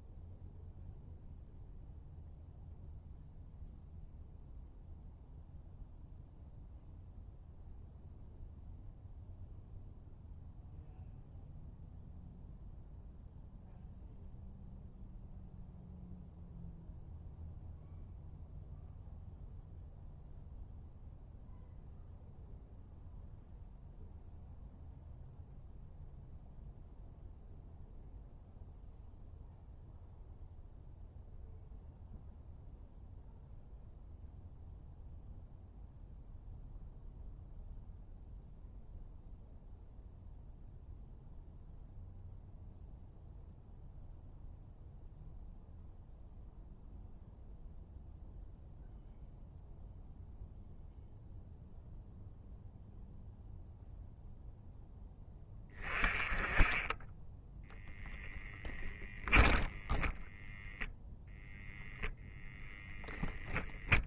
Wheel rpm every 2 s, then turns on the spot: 0, 0, 0, 0, 0, 0, 0, 0, 0, 0, 0, 0, 0, 0, 0, 0, 0, 0, 0, 0, 0, 0, 0, 0, 0, 0, 0, 0, 20, 20, 0, 0.
58-60